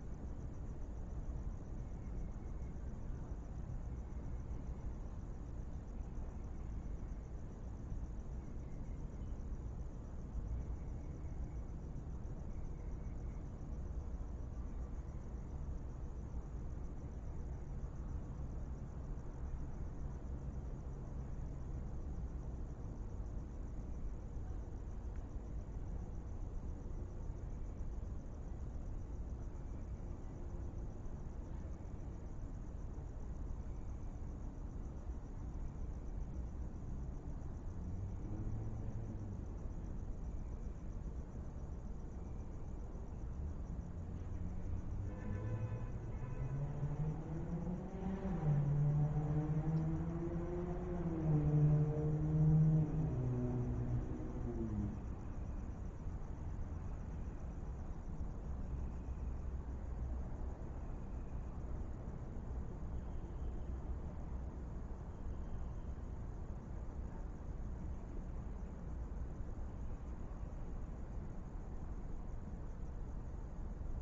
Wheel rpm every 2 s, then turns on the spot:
0, 0, 0, 0, 0, 0, 0, 0, 0, 0, 0, 0, 0, 0, 0, 0, 0, 0, 0, 0, 0, 0, 0, 0, 0, 0, 0, 0, 0, 0, 0, 0, 0, 0, 0, 0, 0.
none